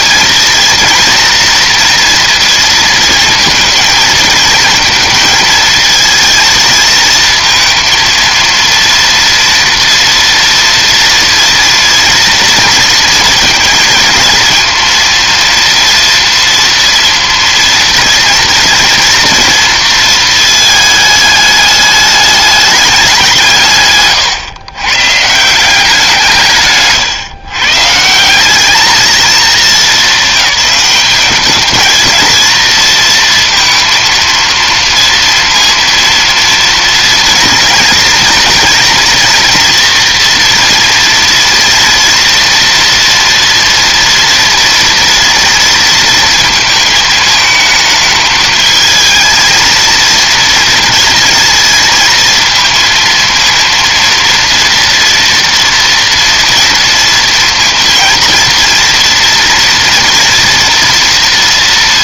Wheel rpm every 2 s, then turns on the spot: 230, 230, 230, 230, 230, 230, 230, 230, 230, 230, 220, 200, 120, 140, 200, 210, 230, 230, 230, 240, 230, 230, 230, 220, 220, 230, 230, 230, 230, 230, 230.
none